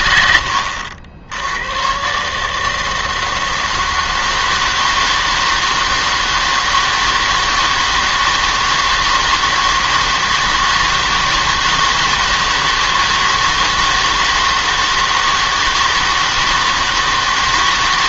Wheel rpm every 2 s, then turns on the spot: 90, 150, 160, 160, 160, 160, 160, 160, 160.
none